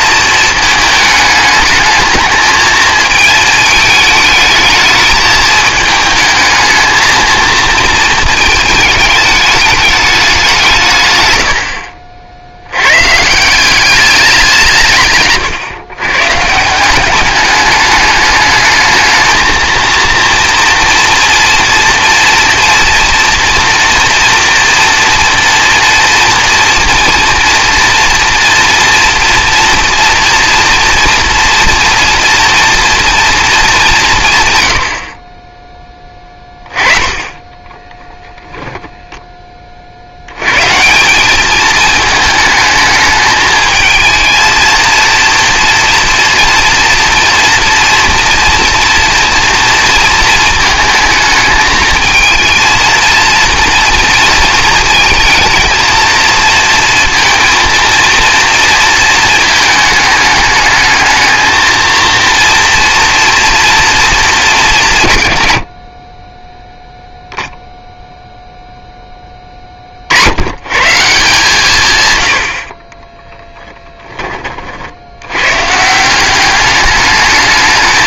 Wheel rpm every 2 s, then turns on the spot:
220, 220, 220, 220, 220, 170, 90, 170, 160, 210, 230, 230, 230, 230, 230, 240, 230, 120, 20, 0, 140, 220, 230, 240, 240, 220, 230, 230, 230, 230, 210, 230, 180, 10, 0, 120, 30, 50, 200.
none